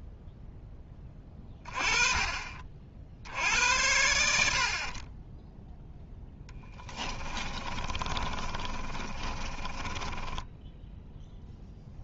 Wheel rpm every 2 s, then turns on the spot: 10, 30, 70, 10, 30, 10.
6-12